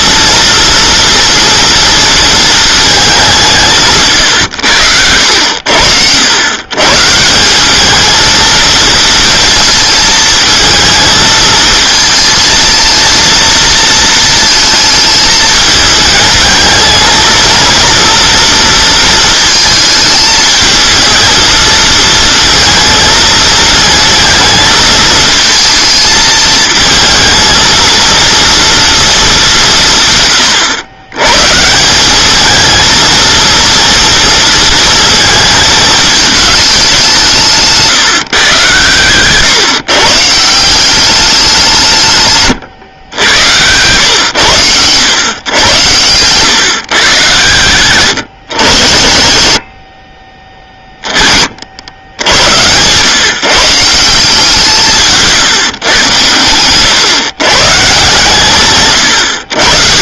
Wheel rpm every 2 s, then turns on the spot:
230, 220, 100, 130, 230, 220, 230, 220, 220, 230, 220, 230, 220, 220, 230, 90, 220, 230, 210, 120, 180, 120, 110, 120, 60, 20, 110, 170, 110, 130.
42-44